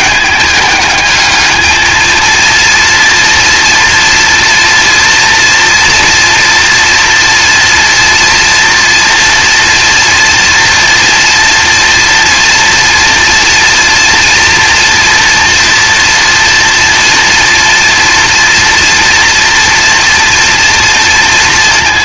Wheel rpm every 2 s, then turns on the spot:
210, 230, 230, 230, 230, 230, 230, 230, 240, 230, 230.
none